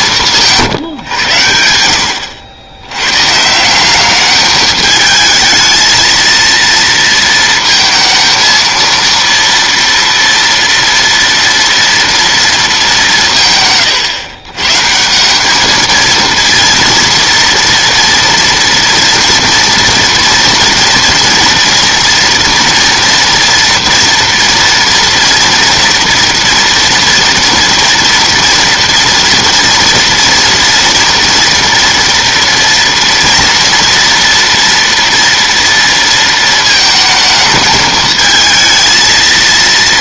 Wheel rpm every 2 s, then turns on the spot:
160, 100, 210, 230, 230, 230, 220, 140, 230, 230, 230, 230, 230, 230, 240, 240, 230, 230, 220, 220.
none